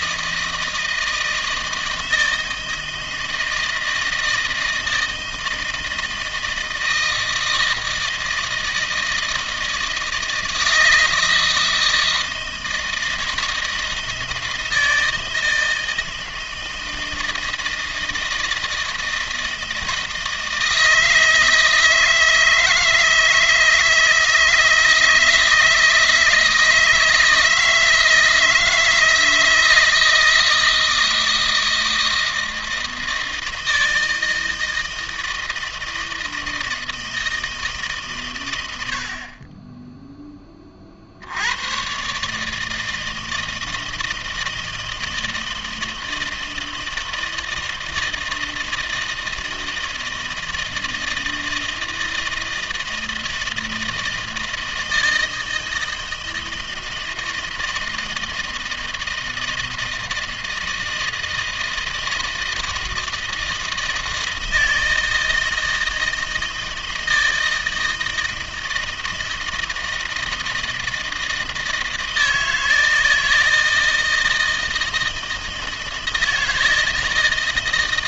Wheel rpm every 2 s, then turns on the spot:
160, 160, 160, 160, 160, 160, 160, 160, 160, 160, 160, 160, 160, 160, 160, 160, 160, 160, 160, 100, 20, 160, 160, 160, 160, 160, 160, 160, 160, 160, 160, 160, 160, 160, 160, 160, 160, 160, 160.
none